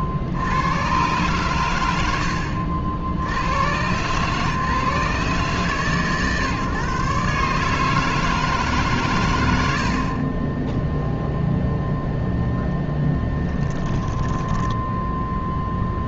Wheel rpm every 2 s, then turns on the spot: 80, 70, 140, 130, 160, 30, 0, 10.
14-16